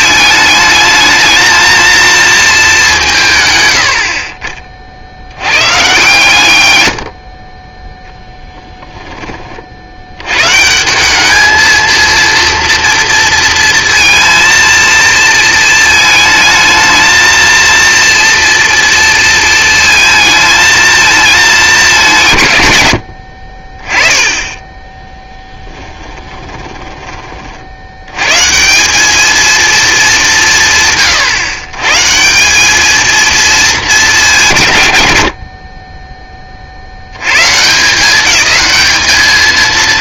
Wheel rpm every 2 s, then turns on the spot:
220, 200, 40, 120, 10, 180, 230, 230, 220, 230, 220, 130, 20, 10, 170, 150, 200, 140, 60, 210.
8-10 26-28